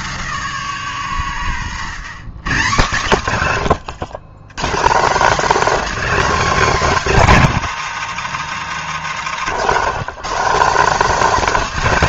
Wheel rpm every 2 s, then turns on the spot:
160, 160, 170, 260, 170, 230.
8-10